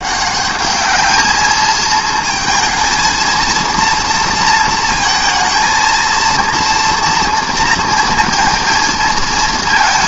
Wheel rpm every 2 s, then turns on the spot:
210, 220, 220, 230, 220.
none